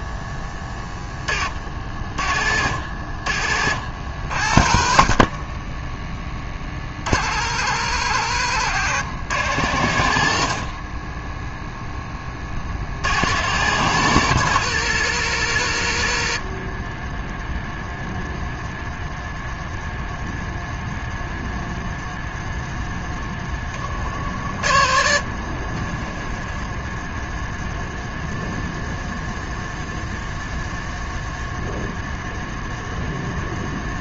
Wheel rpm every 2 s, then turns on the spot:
10, 50, 70, 30, 90, 50, 30, 110, 40, 0, 0, 0, 40, 10, 0, 0, 0.
4-6 8-10